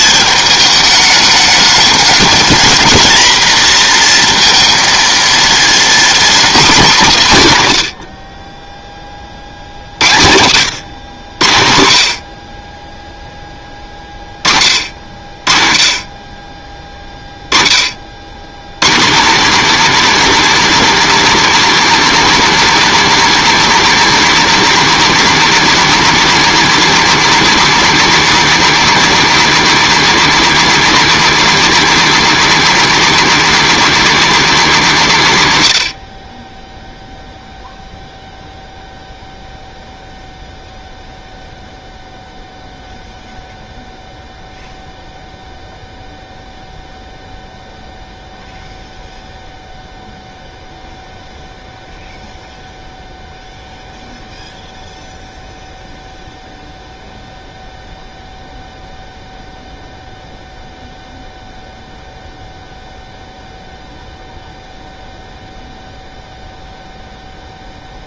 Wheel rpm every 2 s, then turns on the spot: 210, 230, 230, 230, 20, 100, 40, 40, 20, 130, 280, 280, 280, 280, 280, 290, 280, 270, 20, 0, 0, 0, 0, 0, 0, 0, 0, 0, 0, 0, 0, 0, 0, 0.
none